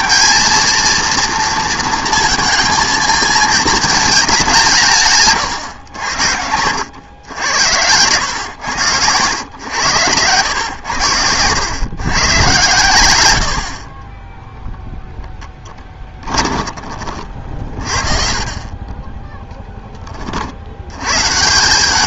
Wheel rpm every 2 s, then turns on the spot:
230, 230, 190, 80, 110, 100, 110, 0, 20, 40, 70.
8-10 16-18